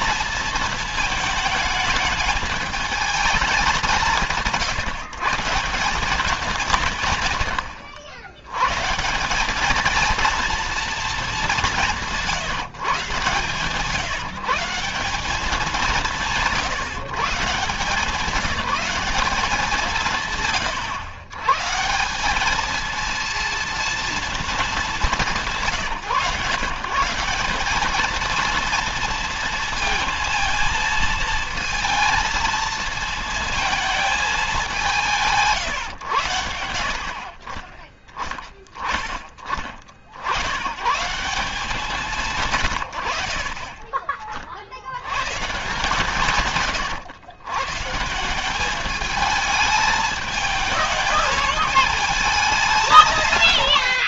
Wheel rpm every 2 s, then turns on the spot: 220, 210, 160, 140, 150, 230, 140, 180, 160, 200, 120, 220, 210, 160, 230, 230, 230, 190, 70, 10, 130, 100, 60, 140, 200, 210, 170.
none